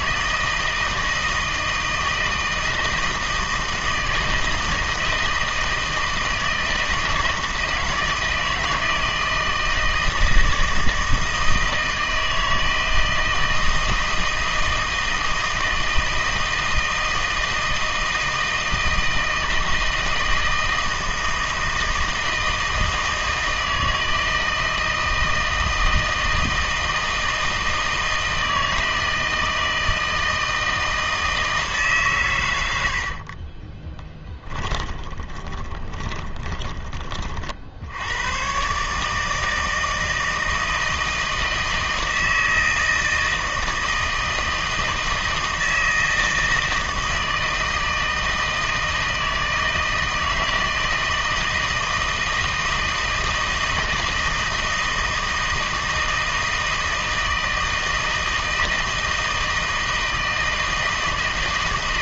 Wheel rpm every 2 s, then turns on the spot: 160, 160, 160, 160, 160, 160, 160, 160, 160, 160, 160, 160, 160, 160, 160, 160, 90, 20, 20, 140, 160, 160, 160, 160, 160, 160, 160, 160, 160, 160, 160.
32-36